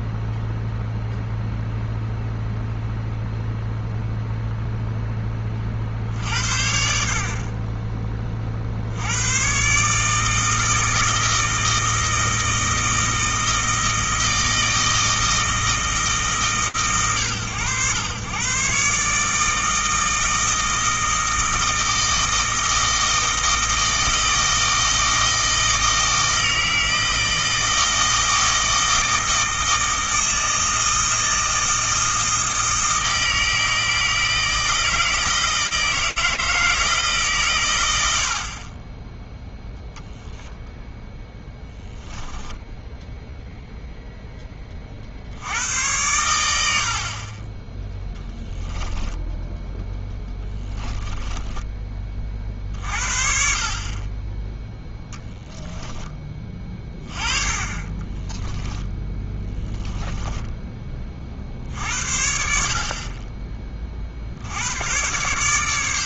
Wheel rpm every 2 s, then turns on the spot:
0, 0, 10, 70, 70, 160, 160, 160, 120, 140, 160, 160, 160, 160, 160, 160, 160, 160, 160, 20, 10, 0, 50, 70, 10, 10, 40, 0, 30, 10, 30, 30, 100.
50-52 58-60